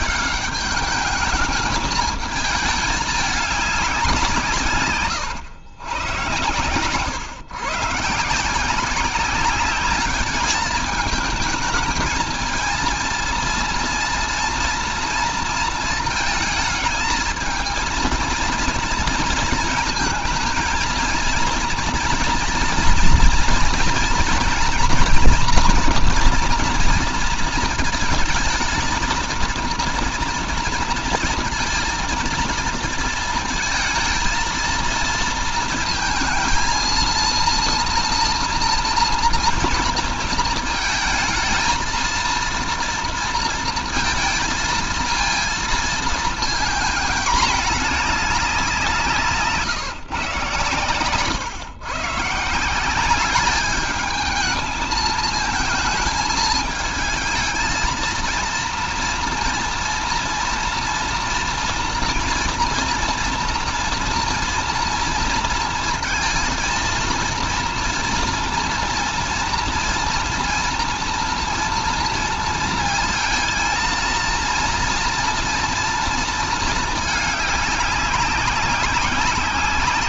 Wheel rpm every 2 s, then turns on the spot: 210, 210, 150, 110, 160, 210, 220, 230, 220, 230, 220, 230, 240, 240, 220, 230, 230, 220, 220, 240, 230, 230, 230, 230, 190, 150, 160, 220, 220, 230, 230, 230, 230, 230, 230, 230, 230, 230, 230, 190.
none